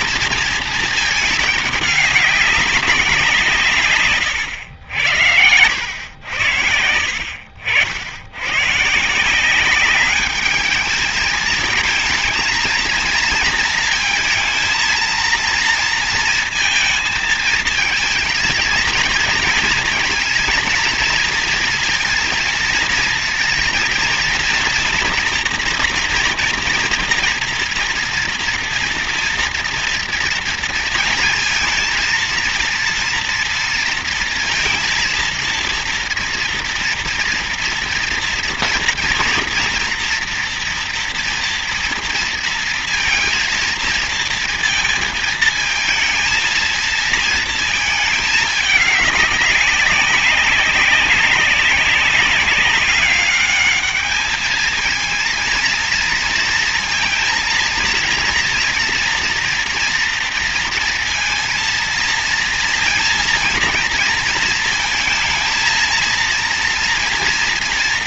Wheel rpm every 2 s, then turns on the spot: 230, 210, 120, 80, 100, 210, 220, 230, 230, 230, 230, 230, 240, 240, 230, 230, 230, 230, 230, 230, 230, 230, 230, 220, 210, 200, 200, 220, 230, 230, 230, 230, 220, 230.
none